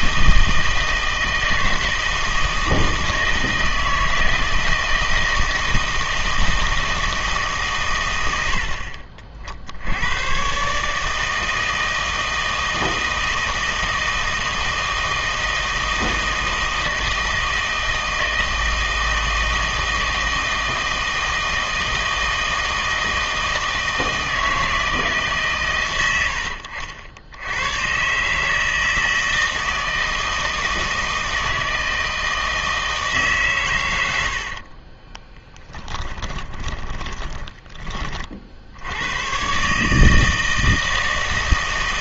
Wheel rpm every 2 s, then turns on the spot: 160, 160, 160, 160, 70, 140, 160, 160, 160, 160, 160, 160, 160, 70, 160, 160, 160, 40, 20, 80, 160.
34-38